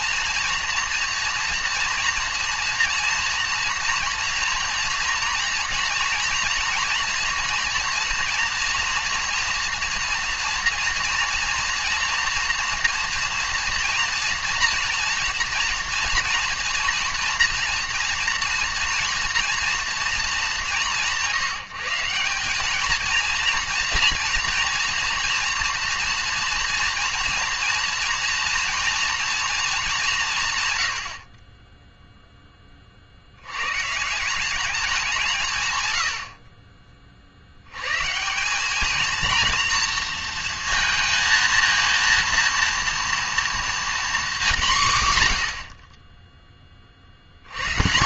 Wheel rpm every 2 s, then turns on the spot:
230, 230, 240, 230, 230, 230, 240, 230, 230, 230, 180, 210, 230, 230, 240, 110, 30, 190, 40, 210, 230, 230, 180, 30.
none